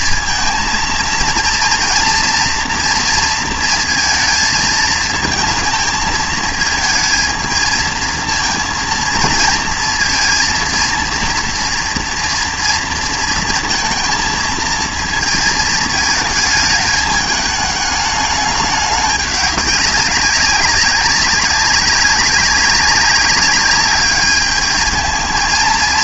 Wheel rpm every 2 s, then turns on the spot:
230, 230, 220, 220, 230, 230, 230, 220, 220, 210, 190, 200, 210.
none